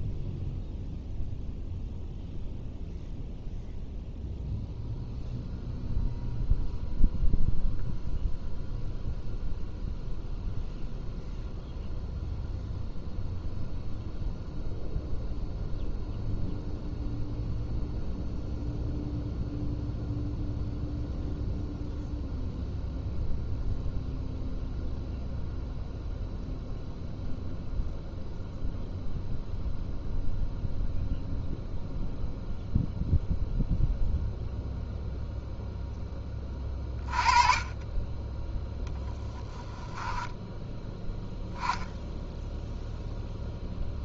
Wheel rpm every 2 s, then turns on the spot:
0, 0, 0, 0, 0, 0, 0, 0, 0, 0, 0, 0, 0, 0, 0, 0, 0, 0, 30, 10, 10, 0.
38-40